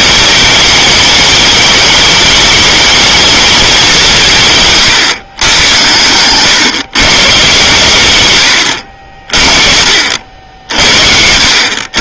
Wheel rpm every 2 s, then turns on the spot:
210, 210, 150, 140, 110, 70.
none